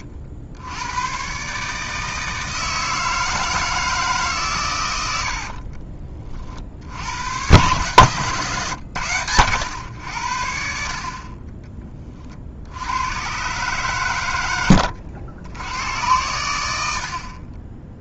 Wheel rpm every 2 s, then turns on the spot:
110, 160, 100, 80, 120, 50, 90, 90, 70.
14-16